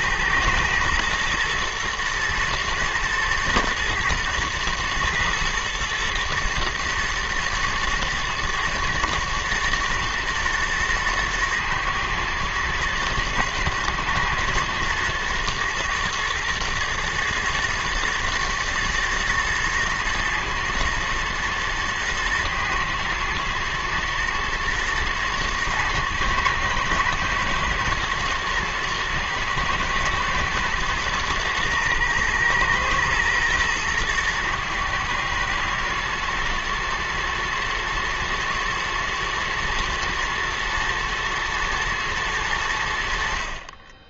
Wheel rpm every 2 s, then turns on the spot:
110, 110, 120, 110, 120, 110, 110, 110, 120, 120, 110, 110, 120, 110, 120, 110, 120, 110, 120, 120, 110, 80.
none